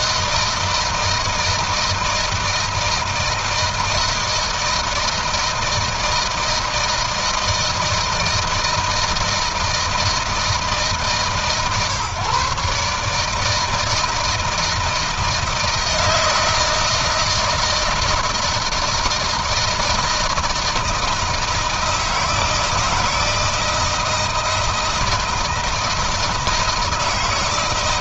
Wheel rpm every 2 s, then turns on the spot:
160, 160, 160, 160, 160, 150, 140, 160, 160, 160, 160, 160, 160, 160.
none